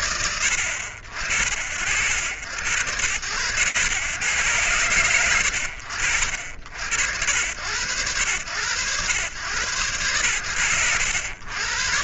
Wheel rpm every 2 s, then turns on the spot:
70, 100, 70, 90, 110, 90.
none